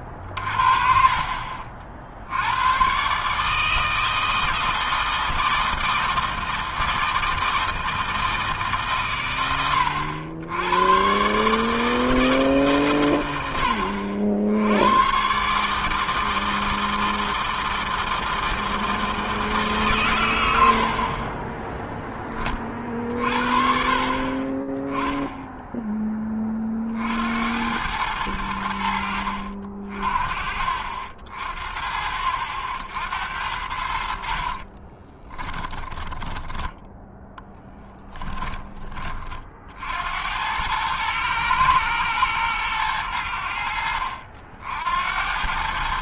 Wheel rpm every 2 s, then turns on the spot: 50, 80, 160, 160, 160, 90, 160, 80, 160, 160, 100, 30, 40, 20, 90, 50, 60, 50, 10, 20, 80, 110, 70.
34-38